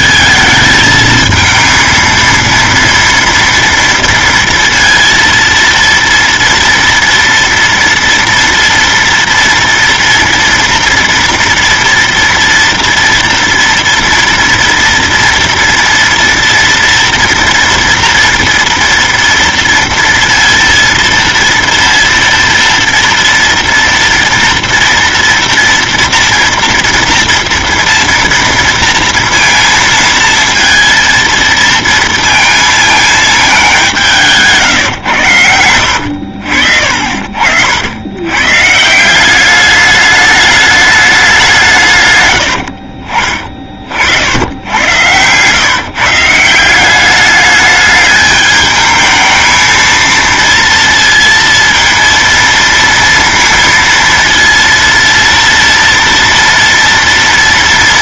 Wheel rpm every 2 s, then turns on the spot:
220, 230, 230, 230, 230, 230, 230, 230, 230, 230, 230, 230, 230, 230, 230, 230, 230, 150, 60, 120, 210, 90, 80, 170, 210, 230, 230, 230, 230.
34-36 42-44